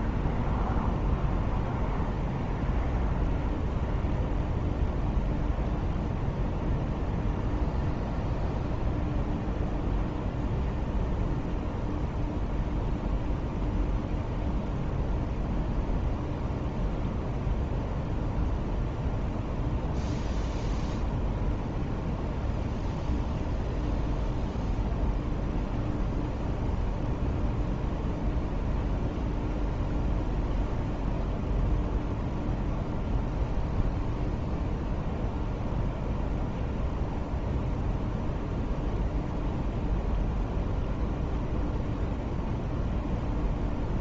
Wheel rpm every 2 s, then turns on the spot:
0, 0, 0, 0, 0, 0, 0, 0, 0, 0, 0, 0, 0, 0, 0, 0, 0, 0, 0, 0, 0, 0.
none